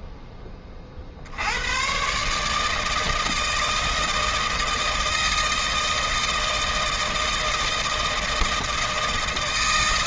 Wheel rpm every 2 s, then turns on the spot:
40, 160, 160, 160, 160.
none